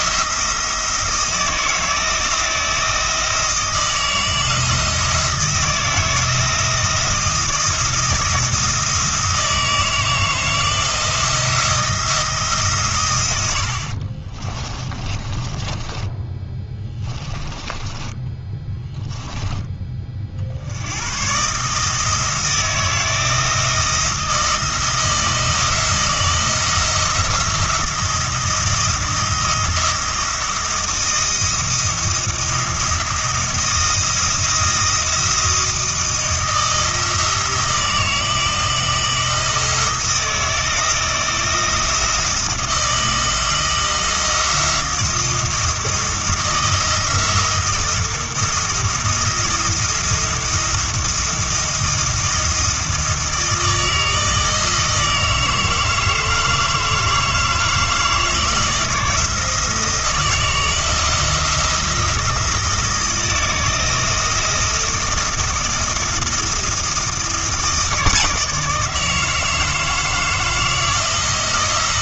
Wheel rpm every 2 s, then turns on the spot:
160, 160, 160, 160, 160, 170, 140, 20, 10, 10, 80, 170, 160, 160, 170, 170, 170, 160, 160, 160, 170, 160, 170, 170, 160, 170, 170, 160, 160, 160, 160, 160, 170, 170, 160, 160.
14-18